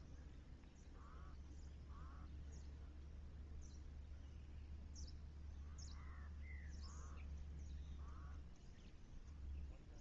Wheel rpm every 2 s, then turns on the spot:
0, 0, 0, 0, 0.
none